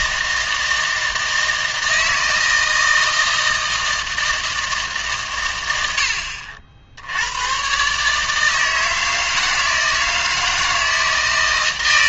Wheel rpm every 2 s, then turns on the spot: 160, 160, 160, 70, 160, 160.
none